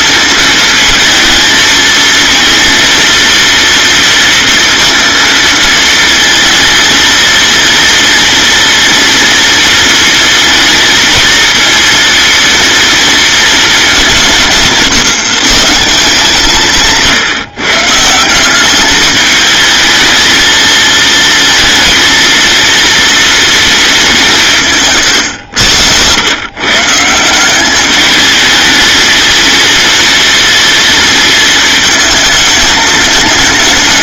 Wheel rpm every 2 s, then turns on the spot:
220, 230, 230, 230, 230, 230, 230, 150, 160, 210, 220, 230, 130, 170, 220, 230, 210.
none